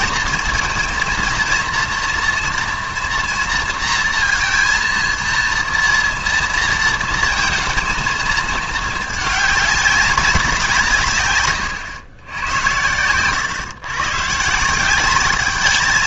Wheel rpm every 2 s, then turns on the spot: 230, 240, 230, 230, 220, 180, 100, 170.
none